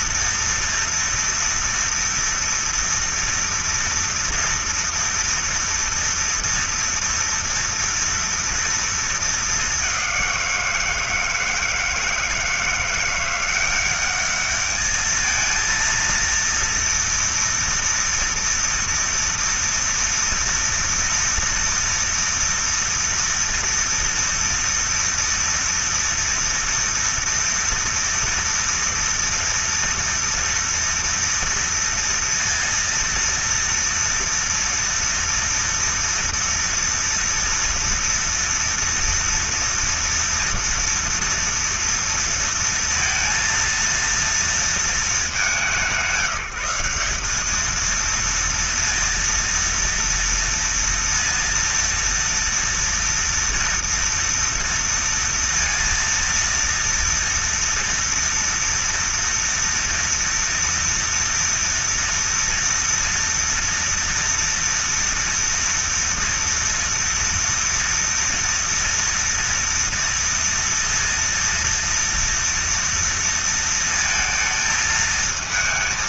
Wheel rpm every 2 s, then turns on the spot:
230, 230, 230, 230, 220, 170, 170, 220, 230, 230, 230, 230, 230, 230, 230, 230, 230, 230, 240, 230, 230, 230, 210, 200, 230, 230, 230, 230, 230, 230, 230, 230, 230, 230, 230, 230, 230, 220.
none